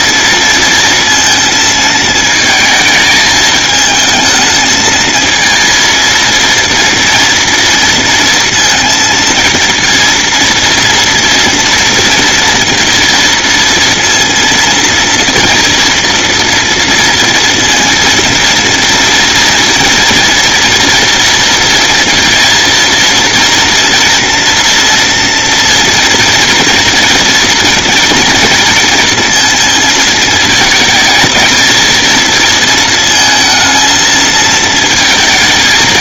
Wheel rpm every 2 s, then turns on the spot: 230, 220, 220, 230, 230, 230, 230, 230, 230, 230, 240, 230, 230, 230, 230, 220, 230, 230.
none